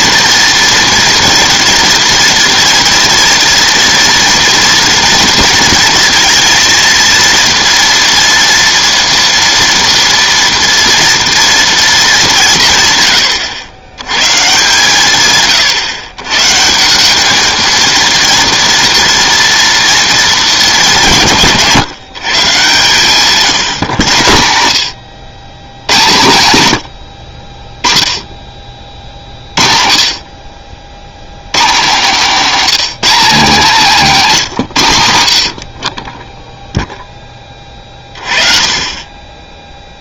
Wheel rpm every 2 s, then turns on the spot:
230, 230, 230, 230, 230, 240, 150, 150, 160, 230, 200, 130, 90, 90, 30, 60, 220, 160, 0, 30.
none